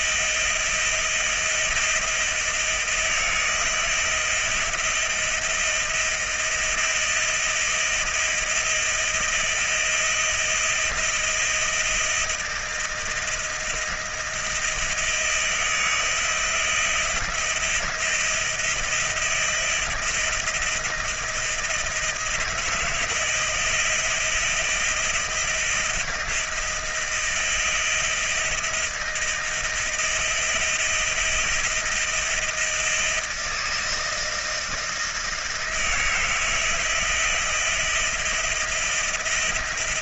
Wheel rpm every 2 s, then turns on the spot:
160, 170, 160, 160, 170, 160, 160, 160, 160, 170, 170, 160, 160, 170, 170, 170, 170, 160, 160, 170.
none